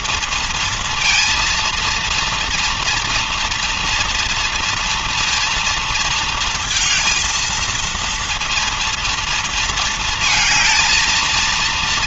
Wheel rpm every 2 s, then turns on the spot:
230, 230, 230, 230, 230, 220.
none